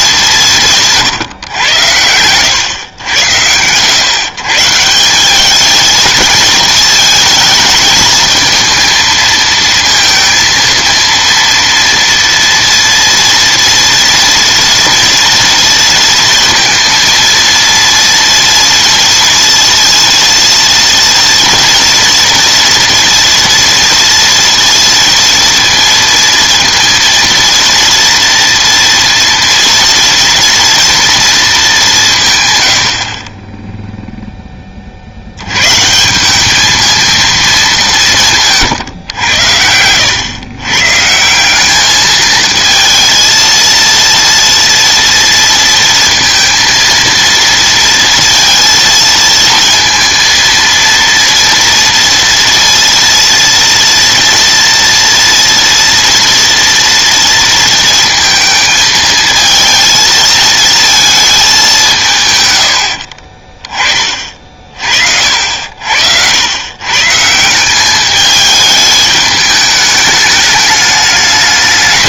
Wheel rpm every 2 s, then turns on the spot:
180, 110, 140, 230, 220, 230, 230, 230, 230, 230, 230, 230, 230, 230, 230, 230, 120, 10, 200, 150, 120, 220, 230, 230, 230, 230, 230, 230, 230, 220, 220, 90, 40, 100, 210, 210.
none